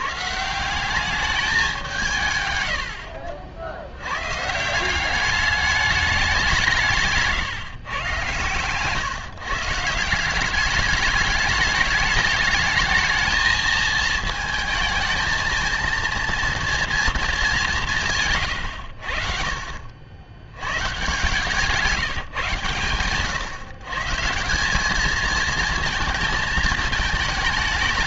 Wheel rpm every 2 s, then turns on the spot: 170, 100, 150, 190, 130, 200, 220, 220, 230, 120, 100, 130, 190, 220.
none